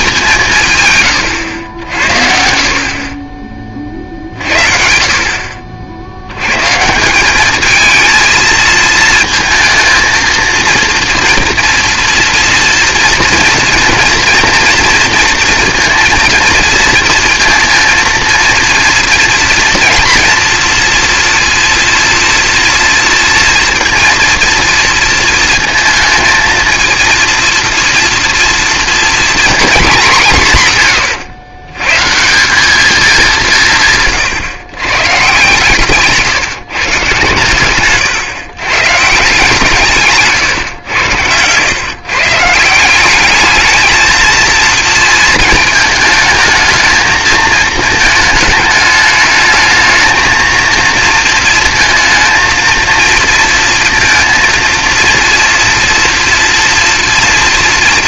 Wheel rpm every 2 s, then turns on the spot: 140, 50, 50, 130, 220, 230, 230, 230, 230, 230, 230, 230, 230, 220, 240, 140, 210, 130, 150, 140, 120, 160, 230, 220, 210, 230, 230, 230, 230.
none